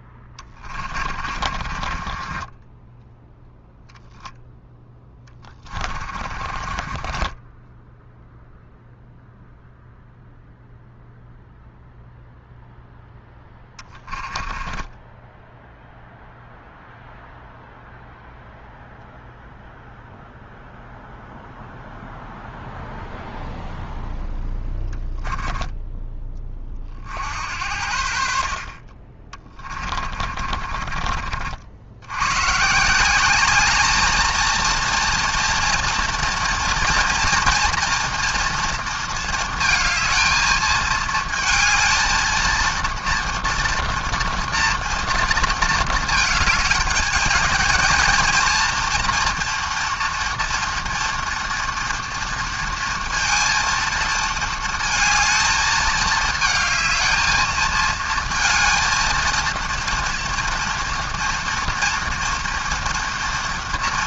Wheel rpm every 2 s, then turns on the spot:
30, 20, 0, 30, 0, 0, 0, 10, 0, 0, 0, 0, 10, 30, 50, 40, 140, 230, 230, 230, 220, 230, 230, 220, 230, 230, 230, 220, 220, 230, 230, 230.
0-4 6-8 14-16 24-26 30-32